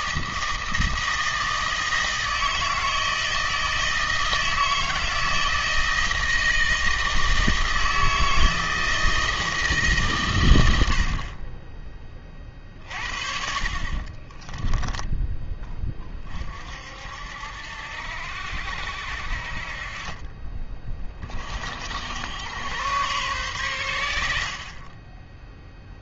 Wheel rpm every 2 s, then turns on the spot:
160, 160, 160, 160, 160, 90, 40, 20, 50, 70, 20, 100, 50.
14-16